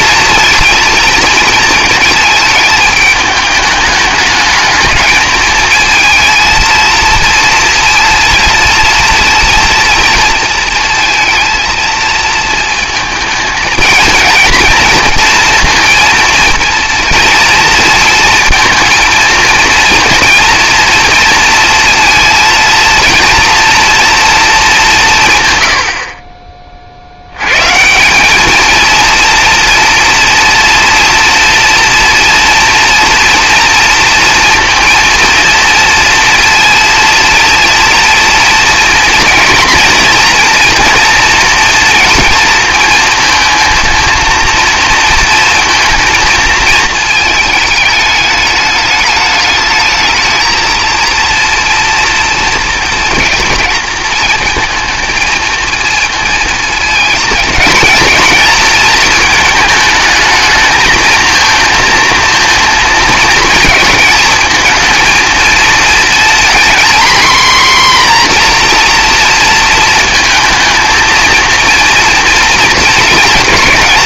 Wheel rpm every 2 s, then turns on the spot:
230, 210, 220, 230, 230, 230, 230, 230, 230, 230, 230, 230, 210, 40, 220, 240, 230, 230, 230, 230, 230, 230, 230, 220, 210, 230, 230, 230, 220, 220, 220, 230, 220, 240, 240, 230, 220.
none